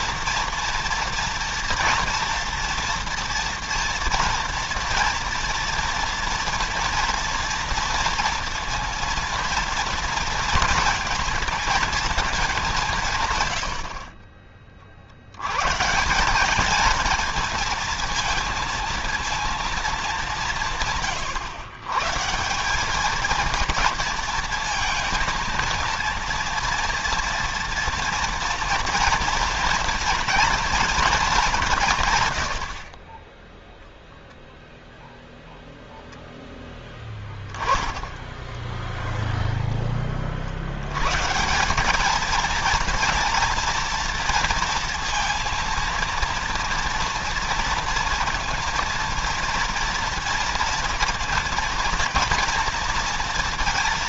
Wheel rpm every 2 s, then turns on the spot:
230, 230, 230, 230, 230, 230, 190, 40, 210, 230, 160, 190, 220, 230, 230, 240, 80, 0, 0, 0, 70, 230, 230, 230, 230, 230, 230.
none